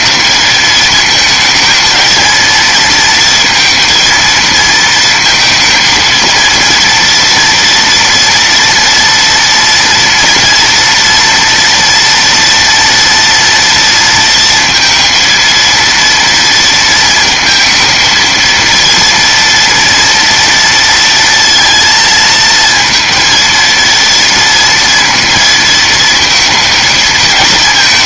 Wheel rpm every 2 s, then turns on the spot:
220, 230, 230, 230, 230, 230, 230, 230, 230, 230, 230, 220, 230, 220.
none